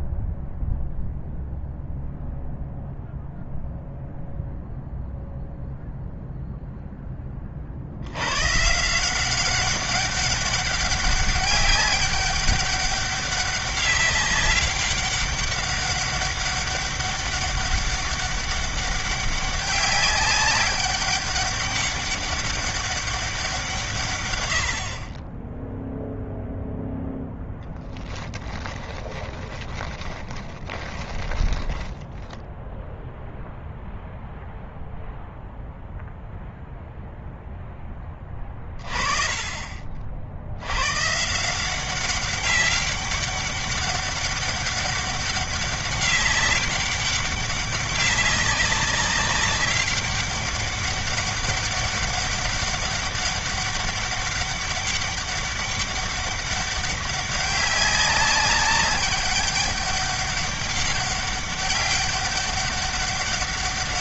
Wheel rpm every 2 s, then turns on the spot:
0, 0, 0, 10, 160, 200, 200, 200, 200, 200, 200, 200, 50, 0, 20, 20, 0, 0, 0, 30, 110, 200, 200, 200, 200, 200, 200, 200, 200, 200, 200, 200.
28-32